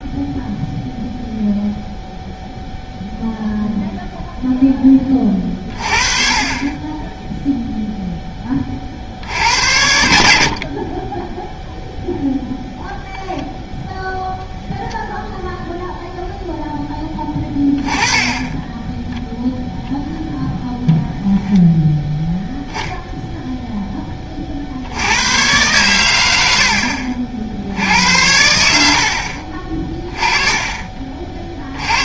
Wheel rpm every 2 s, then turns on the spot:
0, 0, 10, 30, 30, 60, 0, 10, 0, 10, 0, 0, 50, 80, 90, 20.
none